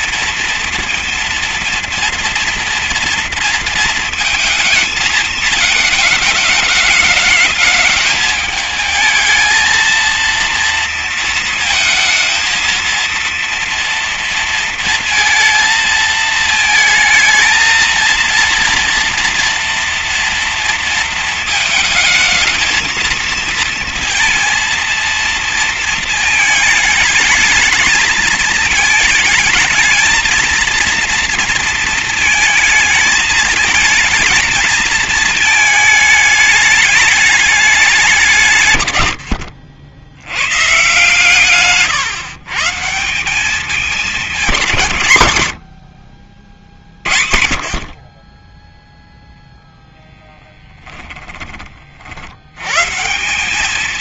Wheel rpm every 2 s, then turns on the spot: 230, 230, 220, 210, 220, 230, 230, 220, 220, 230, 230, 220, 220, 220, 220, 230, 220, 220, 210, 110, 140, 190, 100, 70, 0, 20, 170.
none